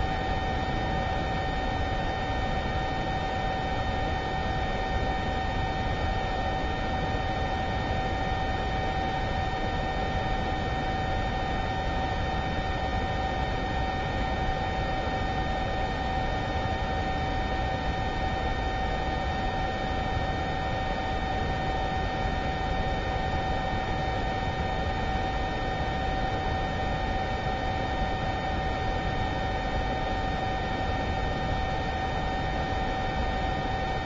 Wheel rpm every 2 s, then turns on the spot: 0, 0, 0, 0, 0, 0, 0, 0, 0, 0, 0, 0, 0, 0, 0, 0, 0.
none